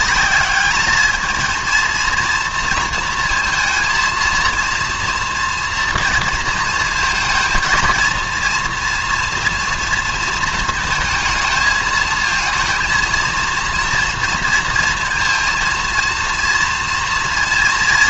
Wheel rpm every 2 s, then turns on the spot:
210, 220, 230, 220, 230, 230, 230, 230, 230.
none